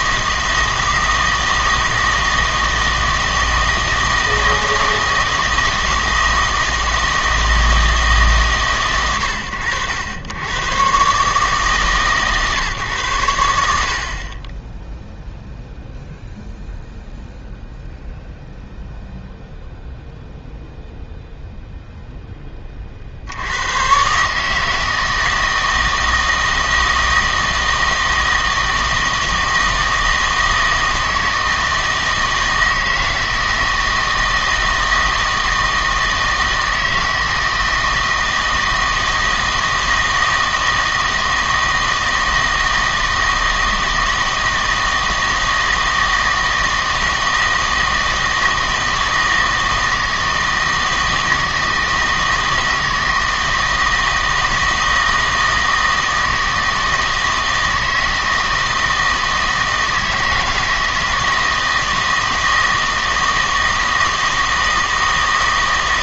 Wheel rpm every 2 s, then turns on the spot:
160, 160, 160, 160, 120, 120, 130, 10, 0, 0, 0, 30, 160, 160, 160, 160, 160, 160, 160, 160, 160, 160, 160, 160, 160, 160, 160, 160, 160, 160, 160, 160, 160.
none